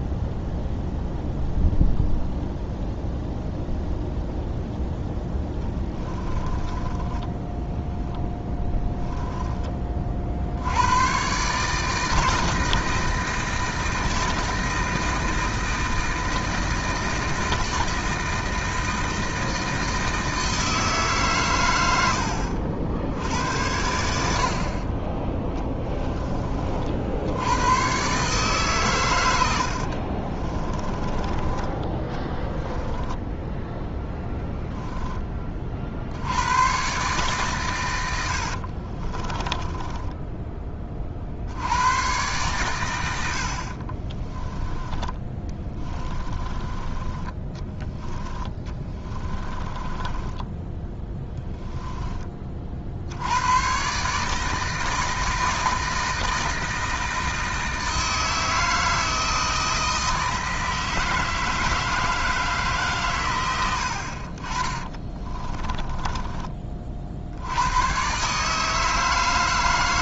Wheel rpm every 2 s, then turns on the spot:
0, 0, 0, 20, 10, 90, 160, 160, 160, 160, 150, 60, 30, 60, 110, 20, 10, 10, 130, 40, 40, 90, 20, 20, 20, 10, 60, 160, 160, 160, 160, 130, 20, 50, 160.
6-10 30-34 38-40 44-46 48-52 64-66